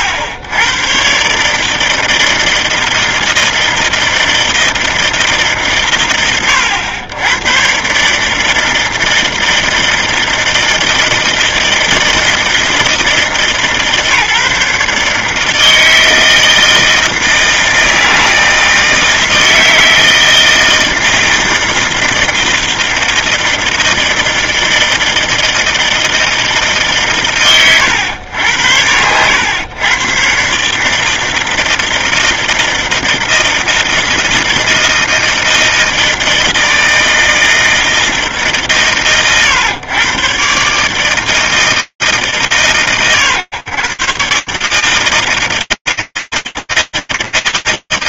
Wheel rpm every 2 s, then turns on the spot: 100, 160, 160, 100, 160, 160, 160, 150, 160, 160, 160, 160, 160, 120, 100, 160, 160, 160, 160, 120, 160, 120, 160, 110.
none